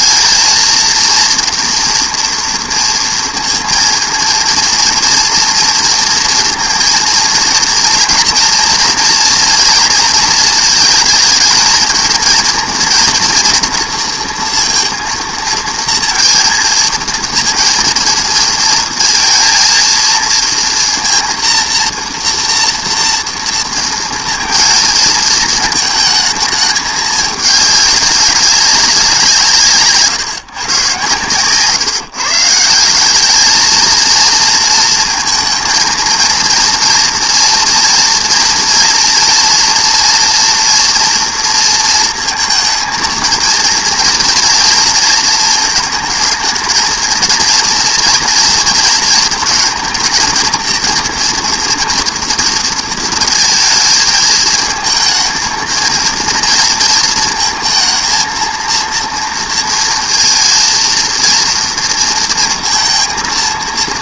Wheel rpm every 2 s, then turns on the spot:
230, 230, 230, 230, 240, 230, 230, 230, 230, 230, 230, 230, 230, 220, 190, 150, 160, 230, 230, 230, 240, 230, 230, 220, 230, 230, 230, 220, 230, 230, 230, 230.
none